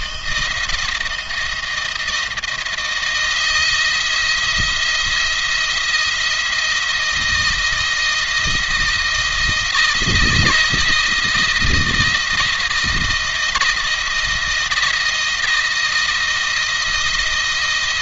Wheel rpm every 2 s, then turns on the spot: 170, 170, 170, 170, 160, 160, 160, 160, 160.
none